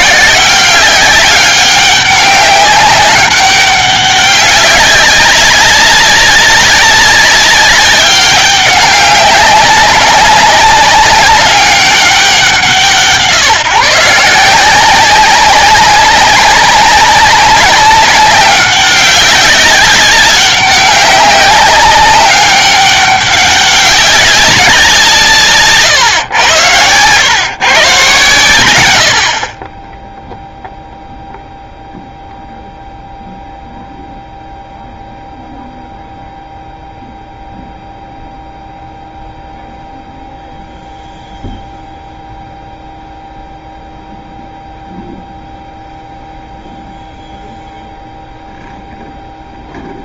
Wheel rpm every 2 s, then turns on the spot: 190, 200, 200, 200, 200, 200, 150, 180, 200, 190, 190, 200, 190, 110, 100, 0, 0, 0, 0, 0, 0, 0, 0, 0, 0.
none